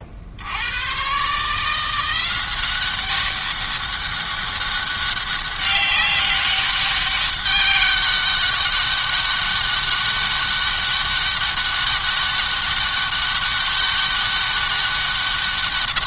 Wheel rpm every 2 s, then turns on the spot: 120, 190, 200, 200, 200, 200, 200, 200.
none